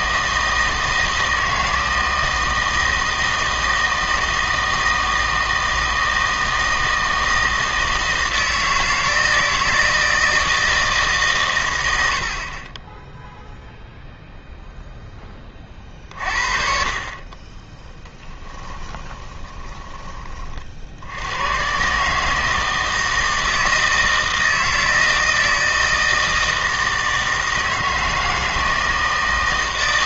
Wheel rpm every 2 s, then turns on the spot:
160, 160, 160, 160, 160, 160, 30, 0, 40, 10, 50, 160, 160, 160, 160.
18-20